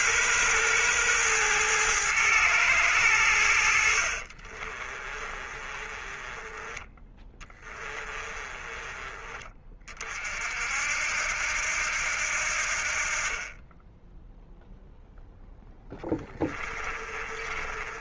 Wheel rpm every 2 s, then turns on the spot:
110, 100, 40, 20, 20, 60, 60, 10, 30.
4-8 16-18